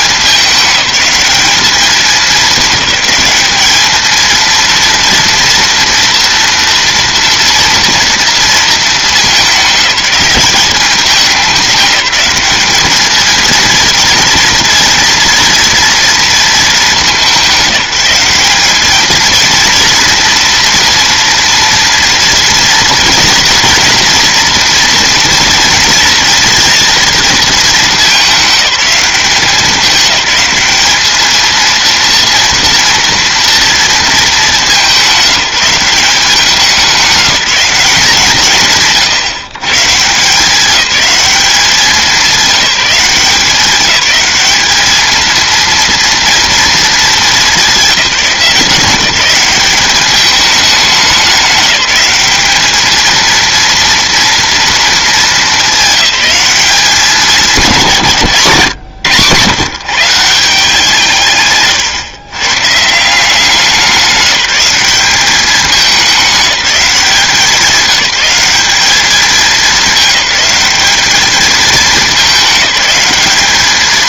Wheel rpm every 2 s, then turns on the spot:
190, 210, 230, 230, 220, 210, 210, 230, 210, 210, 230, 240, 230, 230, 200, 210, 230, 190, 190, 150, 200, 190, 220, 220, 180, 200, 220, 230, 200, 140, 170, 150, 200, 190, 200, 210, 200.
none